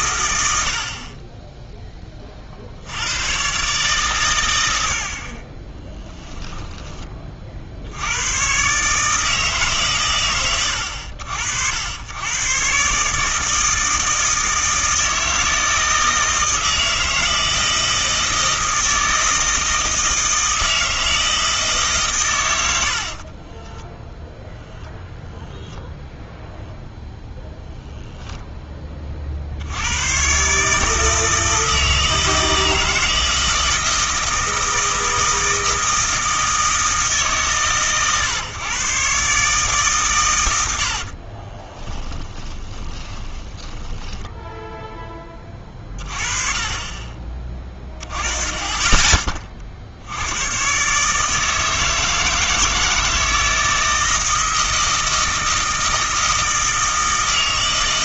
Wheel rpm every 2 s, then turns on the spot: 100, 70, 80, 10, 130, 90, 130, 160, 160, 160, 160, 90, 0, 0, 20, 150, 160, 160, 160, 130, 90, 20, 10, 30, 20, 130, 160, 160, 160.
42-44